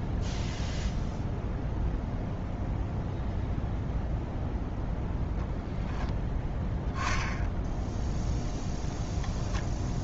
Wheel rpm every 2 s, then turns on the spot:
0, 0, 0, 0, 0.
none